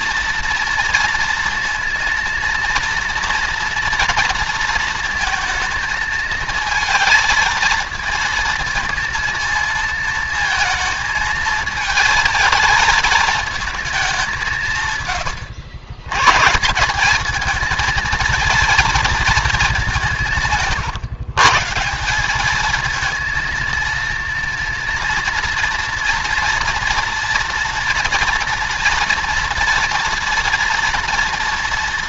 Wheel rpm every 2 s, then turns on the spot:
230, 240, 230, 230, 230, 220, 220, 120, 200, 230, 140, 230, 230, 230, 230, 230.
none